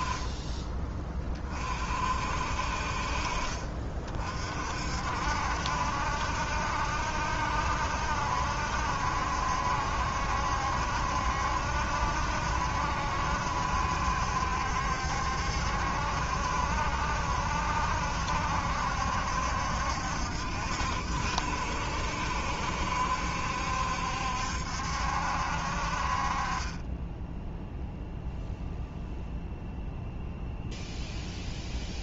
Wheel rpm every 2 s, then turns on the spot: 30, 50, 60, 70, 70, 70, 70, 70, 70, 70, 60, 70, 70, 20, 0, 0.
none